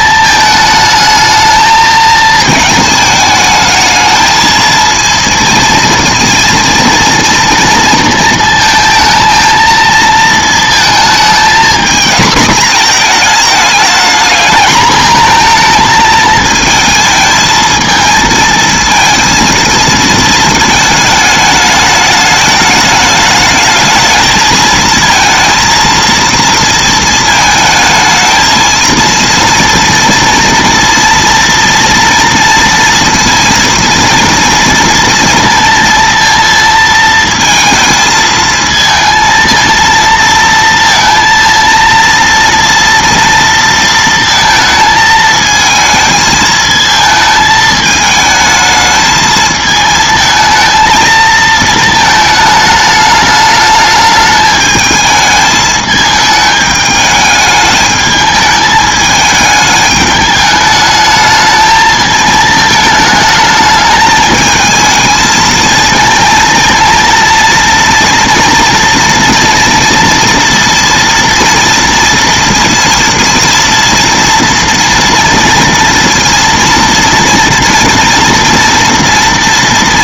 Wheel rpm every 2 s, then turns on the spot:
220, 220, 220, 230, 230, 220, 230, 220, 220, 220, 220, 210, 220, 230, 220, 230, 230, 230, 230, 220, 230, 240, 230, 220, 220, 220, 220, 210, 210, 210, 210, 220, 220, 230, 230, 240, 230, 230, 230, 230.
none